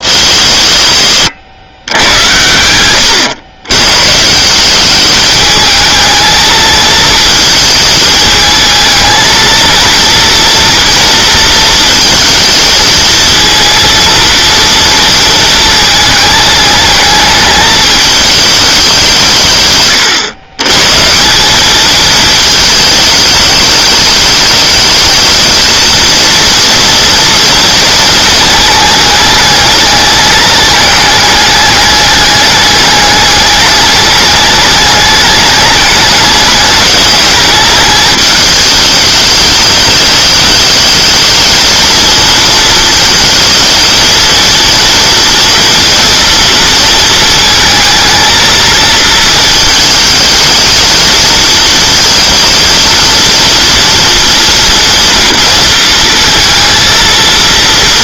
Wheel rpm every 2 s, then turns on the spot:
100, 100, 190, 220, 220, 230, 220, 230, 220, 200, 140, 210, 220, 230, 220, 210, 210, 210, 210, 210, 210, 230, 230, 230, 220, 220, 230, 230, 220.
none